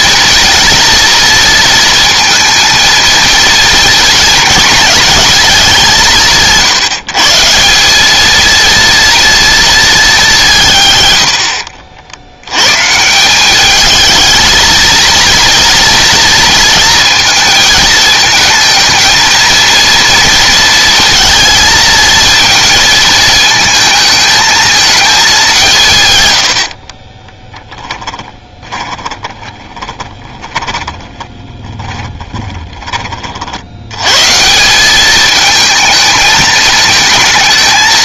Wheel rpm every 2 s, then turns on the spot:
230, 230, 220, 160, 230, 150, 110, 230, 230, 220, 230, 220, 220, 80, 20, 20, 20, 170, 220.
28-32